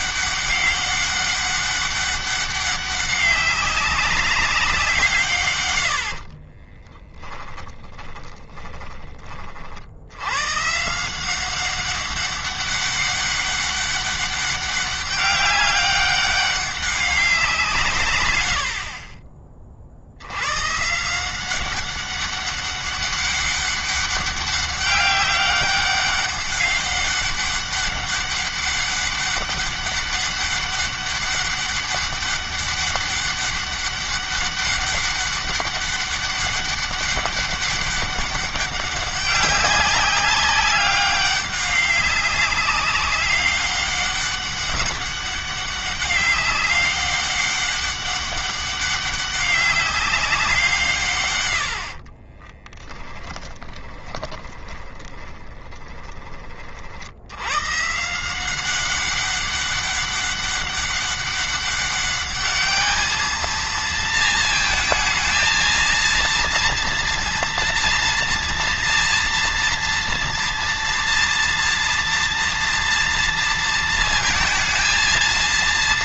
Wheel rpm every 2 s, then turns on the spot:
200, 200, 180, 20, 20, 150, 200, 200, 190, 60, 140, 200, 200, 200, 200, 200, 200, 200, 200, 200, 200, 190, 200, 200, 200, 150, 10, 20, 60, 190, 200, 210, 230, 230, 230, 230, 230, 220.
6-10 52-56